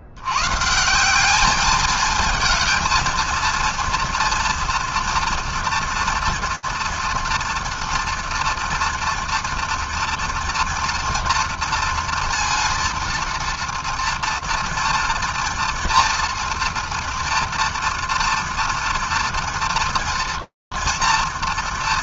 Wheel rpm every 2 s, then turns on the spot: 140, 220, 230, 230, 230, 230, 230, 230, 230, 230, 230.
none